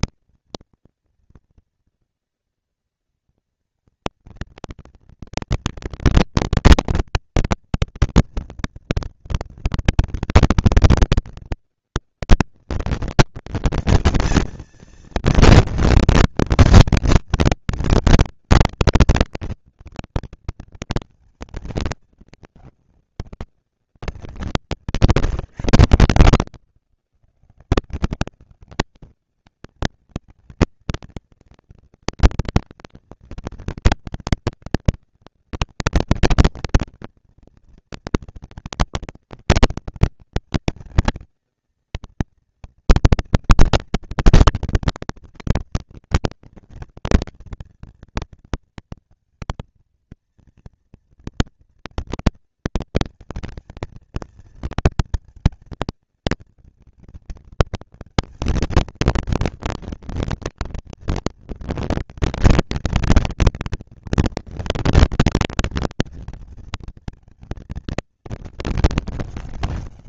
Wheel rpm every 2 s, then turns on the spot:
230, 230, 230, 230, 240, 230, 230, 230, 230, 220, 220, 210, 160, 100, 190, 220, 230, 230, 230, 230, 230, 230, 230, 220, 230, 230, 230, 230, 230, 230, 230, 230, 230, 230, 220.
none